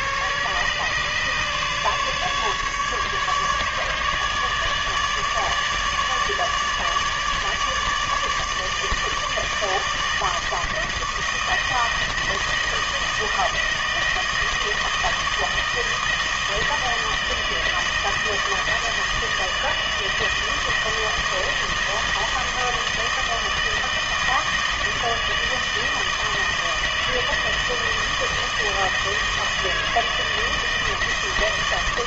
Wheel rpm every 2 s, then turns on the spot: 140, 150, 150, 150, 160, 160, 160, 160, 160, 160, 160, 160, 160, 160, 160, 160.
none